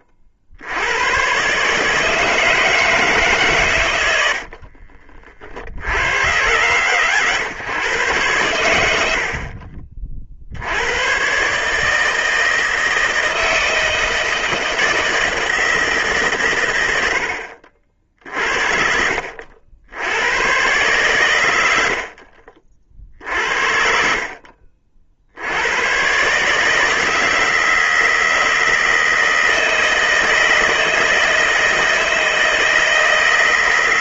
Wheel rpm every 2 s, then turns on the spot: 90, 160, 60, 110, 90, 90, 160, 160, 110, 50, 120, 50, 50, 150, 160, 160, 160.
4-6